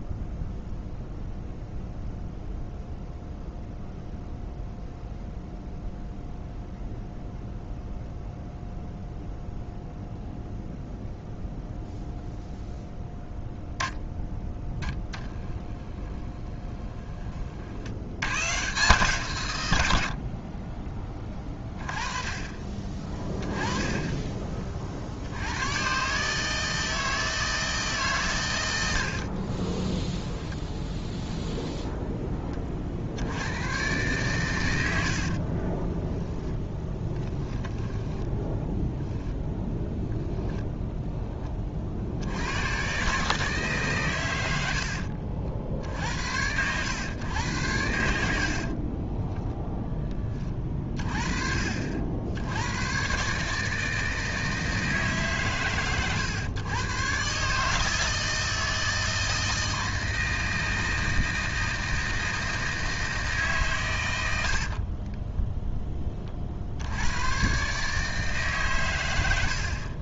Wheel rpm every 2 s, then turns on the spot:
0, 0, 0, 0, 0, 0, 0, 0, 20, 140, 30, 20, 40, 160, 90, 10, 20, 110, 10, 0, 0, 110, 90, 100, 40, 40, 100, 160, 130, 160, 160, 160, 70, 60, 120.
16-18 36-38 48-50